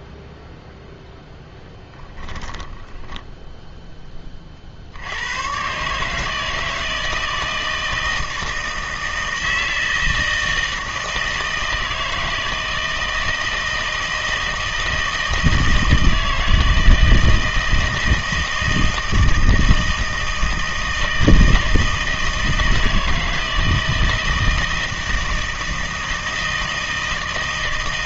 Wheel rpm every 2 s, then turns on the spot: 0, 10, 60, 160, 160, 160, 160, 160, 160, 160, 160, 160, 160, 160.
2-4